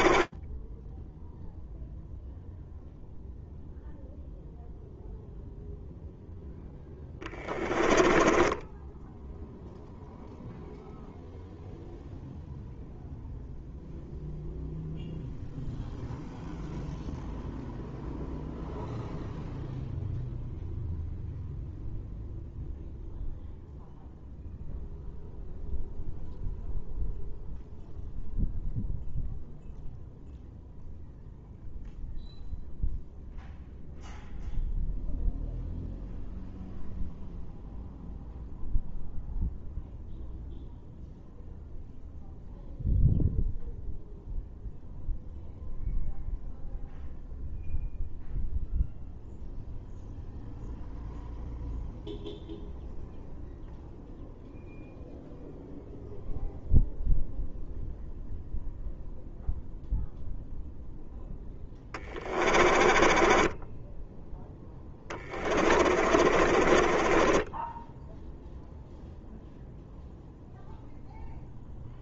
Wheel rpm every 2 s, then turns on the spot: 10, 0, 0, 10, 10, 0, 0, 0, 0, 0, 0, 0, 0, 0, 0, 0, 0, 0, 0, 0, 0, 0, 0, 0, 0, 0, 0, 0, 0, 0, 10, 20, 20, 20, 0, 0.
0-2 6-10 60-68